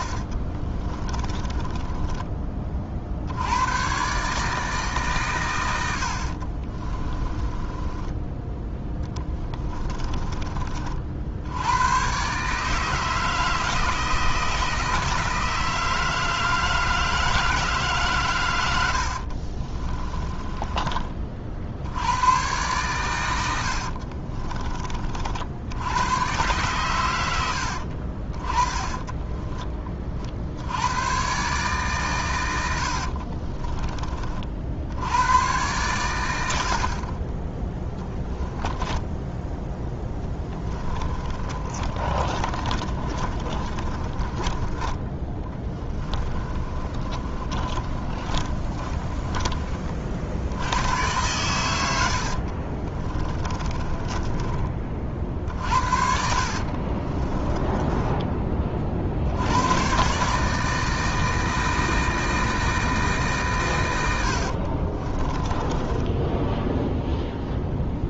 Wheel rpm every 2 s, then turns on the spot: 30, 50, 150, 30, 10, 40, 160, 160, 160, 80, 20, 120, 40, 110, 20, 90, 80, 70, 50, 10, 20, 30, 20, 30, 20, 100, 40, 30, 50, 50, 160, 160, 50, 0.
0-2 6-8 18-20 28-30 32-34 38-44 46-50 52-54 56-58 64-66